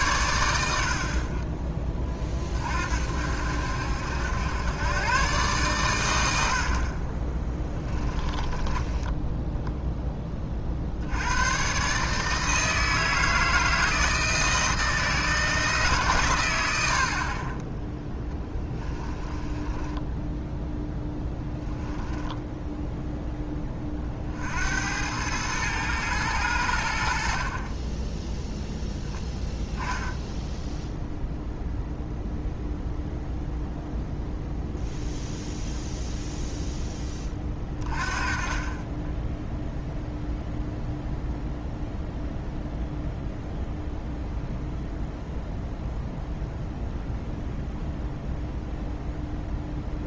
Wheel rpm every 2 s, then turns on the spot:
90, 40, 100, 60, 20, 50, 160, 160, 100, 10, 10, 10, 70, 90, 0, 0, 0, 0, 0, 30, 0, 0, 0, 0, 0.
8-10 18-24